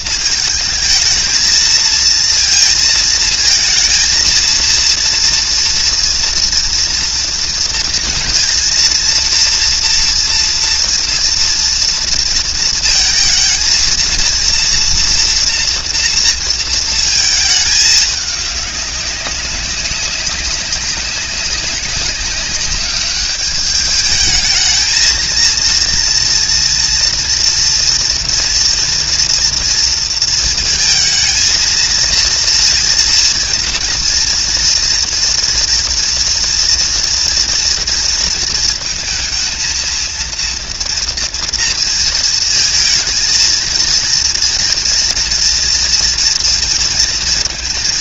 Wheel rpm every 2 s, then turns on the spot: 220, 230, 230, 230, 230, 240, 230, 230, 230, 200, 190, 200, 220, 230, 240, 230, 230, 230, 230, 230, 230, 230, 230, 230.
none